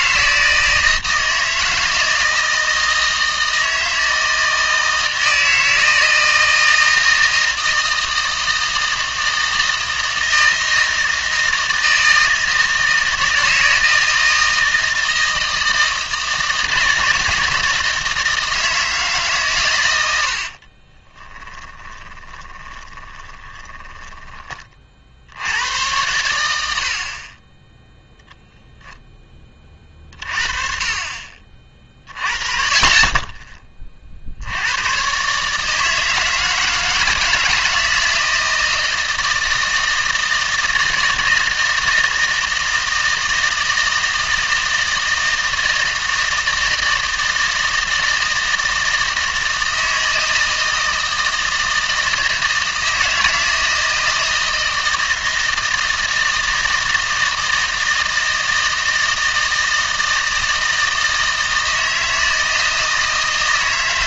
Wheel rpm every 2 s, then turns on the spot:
160, 160, 160, 160, 160, 160, 160, 160, 170, 160, 40, 30, 40, 70, 0, 30, 30, 110, 160, 160, 160, 160, 160, 160, 160, 160, 160, 160, 160, 160, 160, 160.
20-24